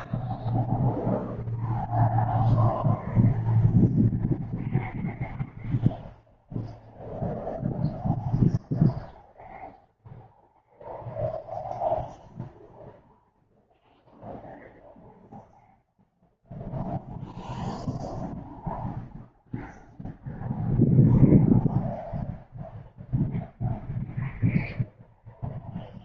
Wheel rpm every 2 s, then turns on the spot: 0, 0, 0, 0, 0, 0, 0, 0, 0, 0, 0, 0, 0.
none